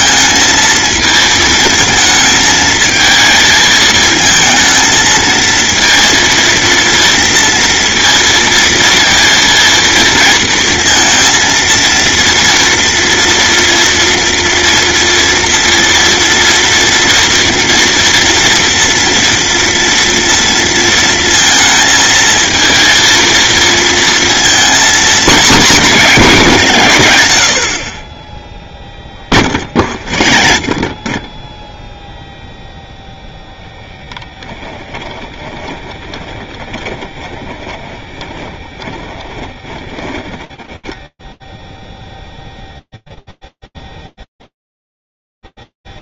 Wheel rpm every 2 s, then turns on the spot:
230, 220, 220, 230, 230, 230, 230, 240, 230, 240, 230, 230, 220, 140, 10, 30, 0, 10, 20, 10, 10, 0, 0.
30-32 34-40